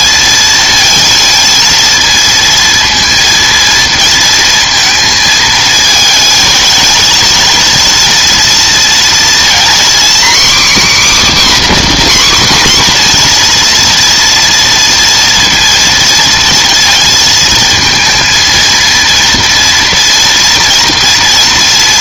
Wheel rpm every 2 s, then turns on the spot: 230, 230, 220, 230, 230, 270, 260, 230, 230, 230, 230.
none